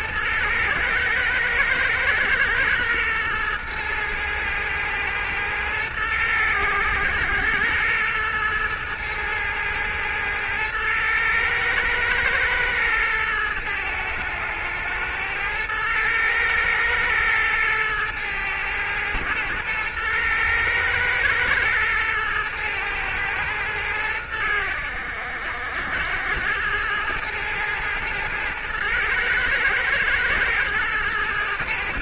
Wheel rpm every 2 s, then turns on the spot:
110, 120, 110, 100, 110, 110, 110, 110, 110, 110, 110, 110, 80, 100, 110, 110.
none